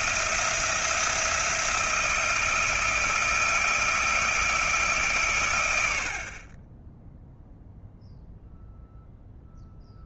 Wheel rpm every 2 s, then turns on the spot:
170, 170, 150, 20, 0.
none